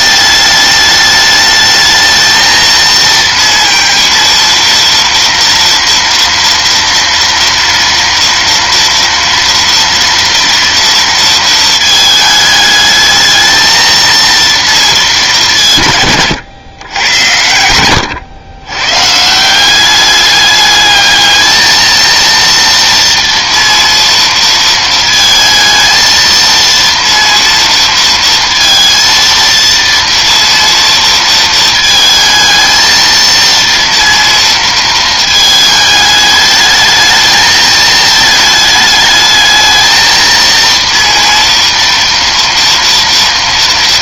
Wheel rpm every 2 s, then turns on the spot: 210, 230, 230, 230, 230, 230, 210, 230, 120, 110, 210, 230, 230, 230, 230, 230, 220, 230, 210, 220, 230, 230.
none